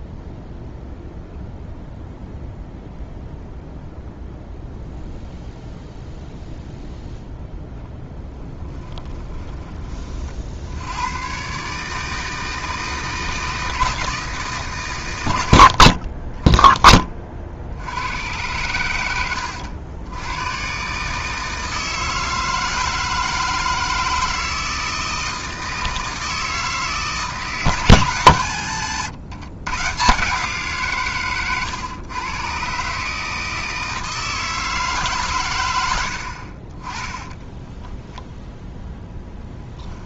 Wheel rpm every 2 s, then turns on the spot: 0, 0, 0, 0, 10, 90, 160, 140, 20, 100, 130, 160, 160, 160, 120, 150, 130, 150, 30, 0.
8-10 28-30